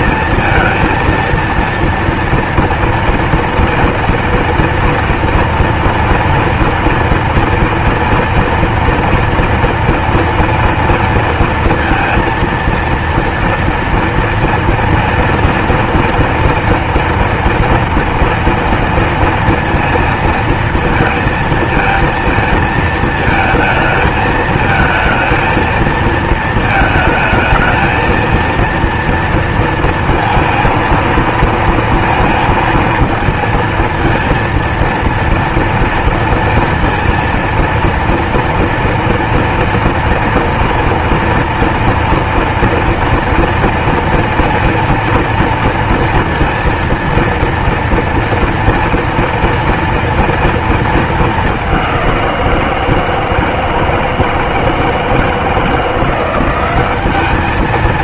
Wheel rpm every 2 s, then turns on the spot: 230, 240, 230, 230, 230, 230, 230, 240, 230, 230, 230, 220, 220, 220, 230, 220, 230, 230, 230, 230, 230, 230, 230, 230, 230, 220, 160, 160, 190.
none